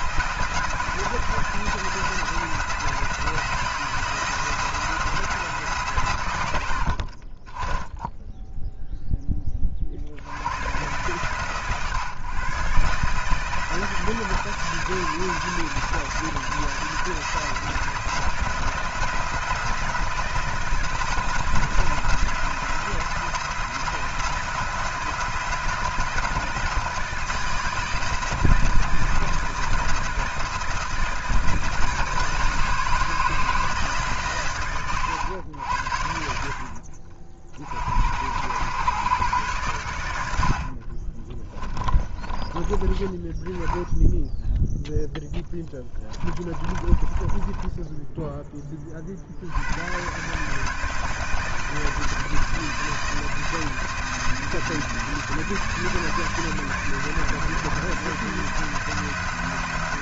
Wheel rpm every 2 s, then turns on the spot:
170, 170, 160, 80, 0, 120, 140, 150, 160, 170, 160, 170, 170, 160, 160, 160, 160, 120, 50, 120, 50, 20, 0, 20, 20, 160, 160, 160, 160, 170.
36-38 40-42 46-48